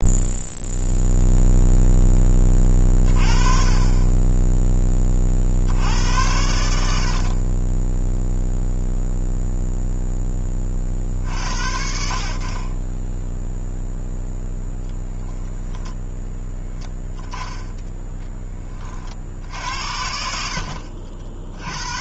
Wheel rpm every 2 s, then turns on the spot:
0, 20, 10, 80, 0, 20, 30, 0, 10, 30, 60.
20-22